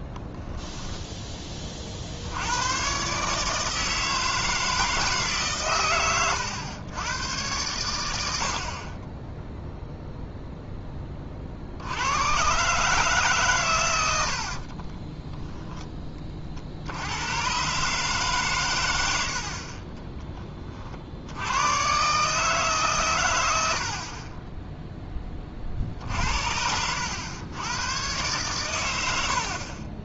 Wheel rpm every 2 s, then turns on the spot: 10, 120, 160, 110, 30, 10, 140, 30, 60, 110, 40, 140, 10, 90, 110.
14-16